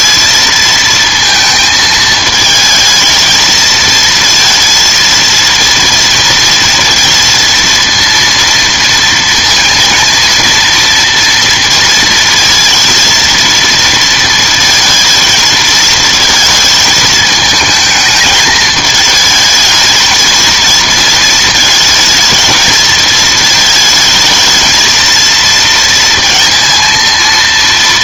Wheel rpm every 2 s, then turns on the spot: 220, 220, 230, 230, 230, 230, 230, 230, 220, 220, 230, 230, 220, 230.
none